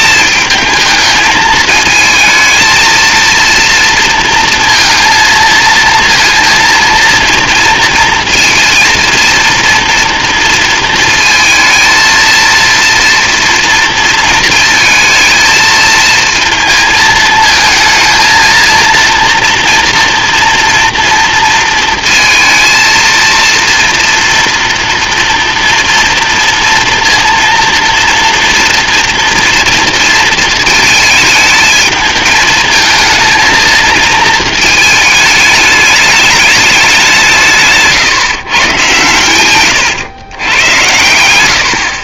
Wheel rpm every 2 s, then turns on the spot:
220, 220, 230, 230, 230, 230, 230, 220, 220, 230, 240, 230, 230, 230, 230, 220, 220, 220, 200, 130, 120.
40-42